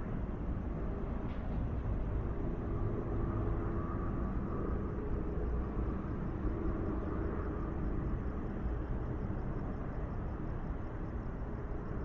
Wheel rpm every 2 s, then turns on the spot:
0, 0, 0, 0, 0, 0.
none